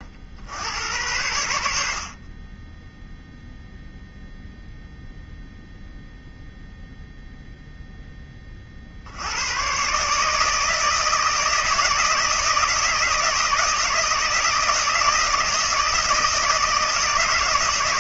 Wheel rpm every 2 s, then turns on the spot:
90, 10, 0, 0, 50, 160, 160, 160, 160.
none